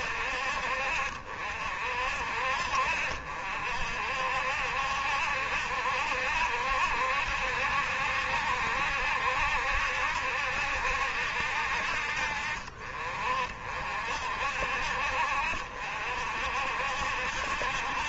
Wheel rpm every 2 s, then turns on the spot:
50, 60, 70, 70, 70, 70, 50, 60, 60.
none